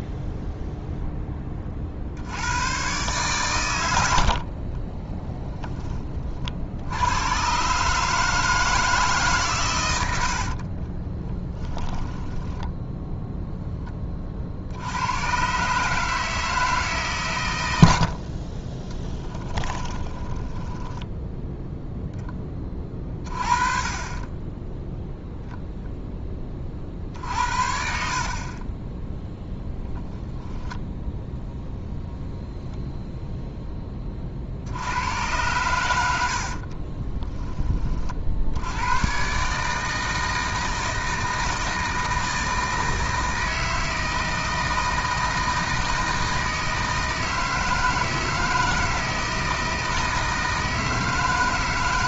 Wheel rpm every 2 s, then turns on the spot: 0, 110, 30, 80, 160, 40, 10, 70, 150, 20, 10, 20, 0, 40, 20, 10, 0, 80, 30, 100, 160, 160, 160, 160, 160, 160.
10-14 18-22 36-38